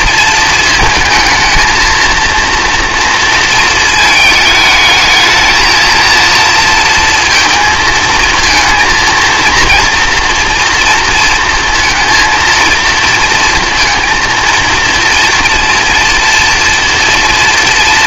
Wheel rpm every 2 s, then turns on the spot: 230, 230, 220, 230, 220, 240, 230, 230, 230.
none